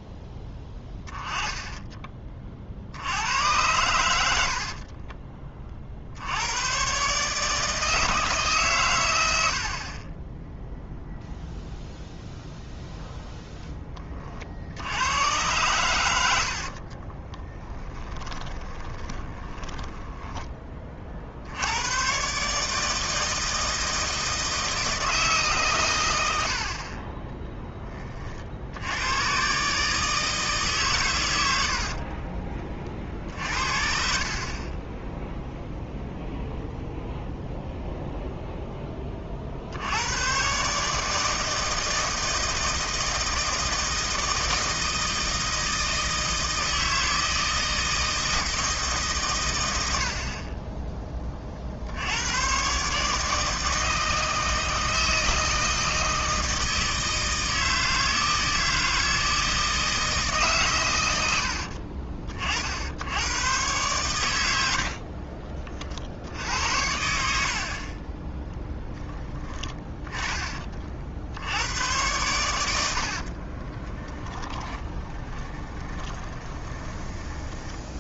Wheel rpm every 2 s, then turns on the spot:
10, 70, 40, 120, 110, 0, 0, 80, 40, 20, 30, 150, 160, 40, 80, 130, 40, 20, 0, 20, 150, 160, 160, 160, 150, 20, 140, 160, 160, 160, 120, 70, 70, 80, 10, 40, 80, 20, 20.
0-2 4-6 16-20 64-68 72-78